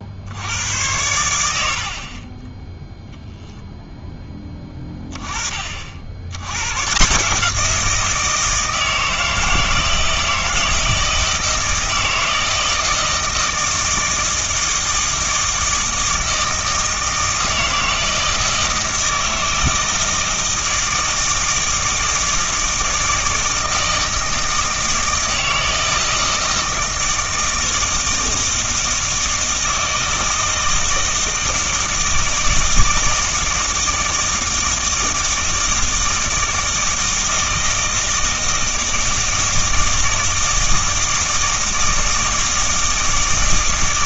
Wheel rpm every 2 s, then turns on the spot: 90, 10, 20, 110, 160, 160, 160, 160, 160, 160, 160, 160, 160, 160, 160, 160, 160, 160, 160, 160, 160, 160.
2-4